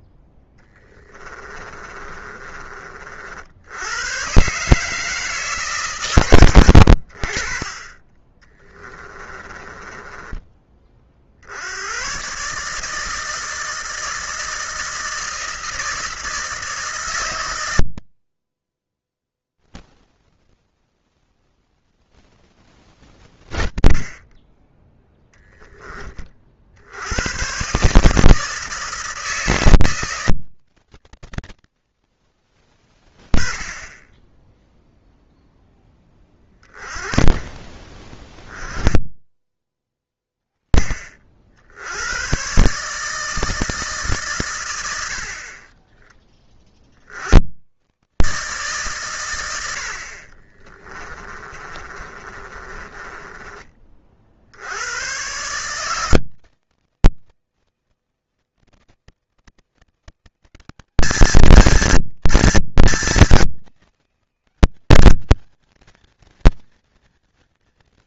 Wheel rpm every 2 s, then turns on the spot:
10, 40, 150, 70, 20, 40, 160, 160, 140, 10, 0, 10, 10, 90, 160, 110, 20, 0, 20, 20, 30, 140, 80, 60, 130, 20, 30, 100, 160, 160, 210, 220, 210, 230.
0-2 8-10 22-26 36-38 50-54